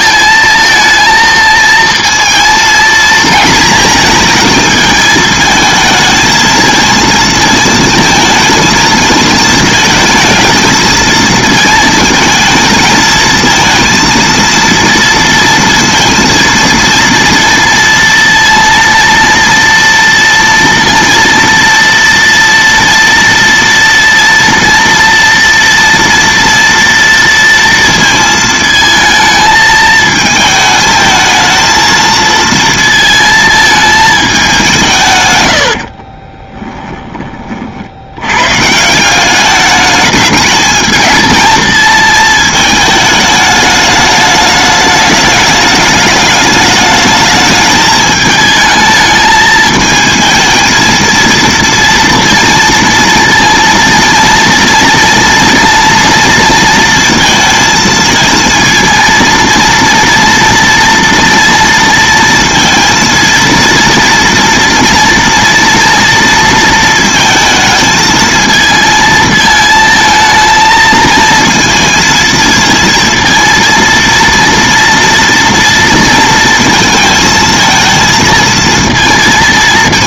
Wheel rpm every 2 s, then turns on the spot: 220, 230, 220, 220, 220, 220, 220, 230, 230, 230, 230, 230, 230, 230, 220, 220, 230, 180, 10, 140, 220, 220, 210, 210, 220, 220, 230, 230, 230, 230, 230, 230, 230, 230, 220, 220, 230, 230, 230, 230.
36-38